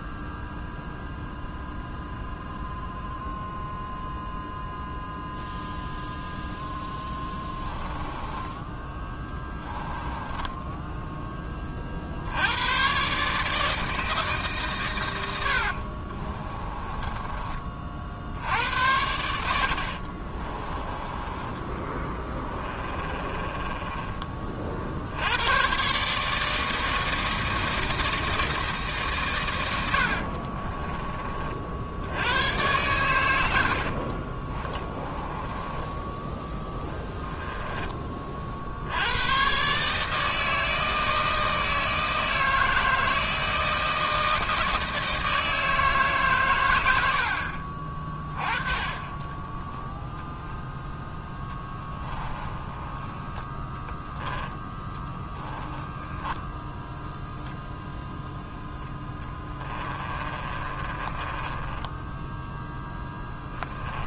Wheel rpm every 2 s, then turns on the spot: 0, 0, 0, 0, 10, 10, 110, 130, 20, 80, 20, 20, 50, 160, 160, 30, 110, 20, 10, 60, 160, 160, 160, 110, 20, 0, 10, 10, 0, 10, 20, 0.
8-12 16-18 20-24 30-32 34-36 52-54 60-62